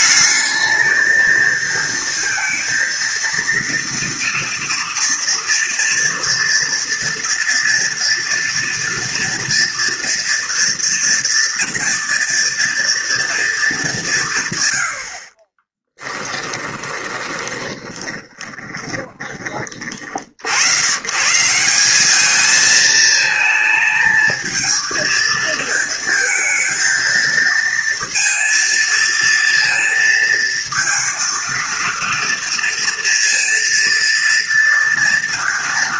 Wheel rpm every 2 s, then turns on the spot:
220, 230, 230, 230, 240, 240, 230, 50, 20, 30, 140, 220, 220, 230, 230, 230, 230, 230.
16-20